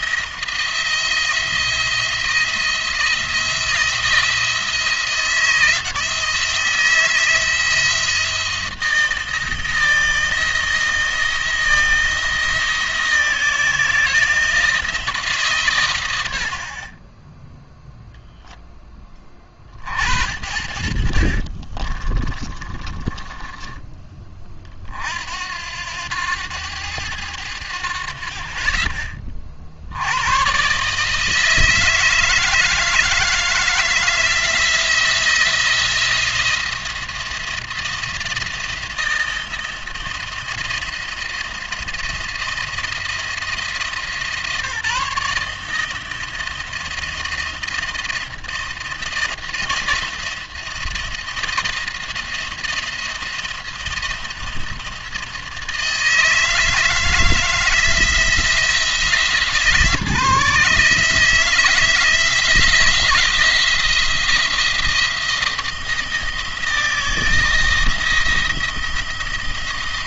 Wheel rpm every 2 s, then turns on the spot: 170, 170, 170, 160, 170, 160, 170, 160, 50, 10, 60, 30, 40, 100, 40, 130, 160, 160, 170, 170, 170, 170, 160, 170, 170, 170, 170, 170, 160, 160, 150, 170, 170, 160, 170.
22-24